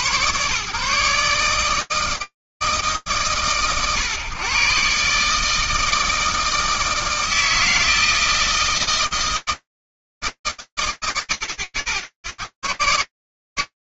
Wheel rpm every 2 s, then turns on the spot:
150, 130, 150, 160, 160, 120, 160.
none